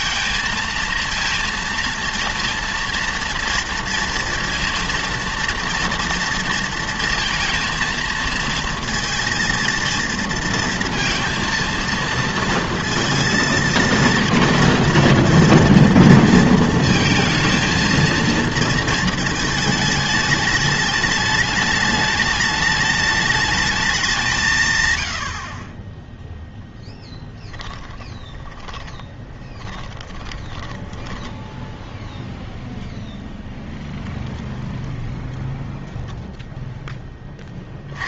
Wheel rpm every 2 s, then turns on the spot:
230, 230, 230, 230, 230, 230, 230, 230, 230, 230, 210, 210, 140, 10, 20, 10, 0, 0, 0.
28-32